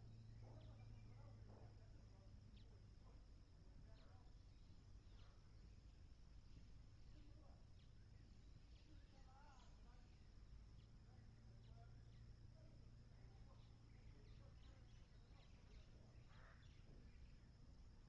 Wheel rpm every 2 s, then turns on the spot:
0, 0, 0, 0, 0, 0, 0, 0, 0.
none